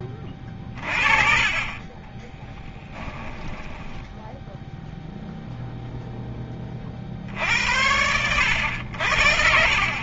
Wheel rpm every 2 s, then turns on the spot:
20, 20, 0, 20, 100.
2-4